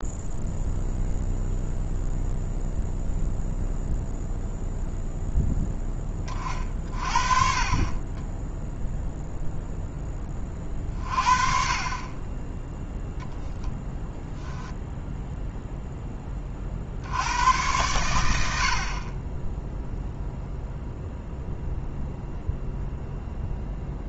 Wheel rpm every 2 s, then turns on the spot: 0, 0, 0, 10, 30, 0, 40, 10, 0, 100, 0, 0.
14-16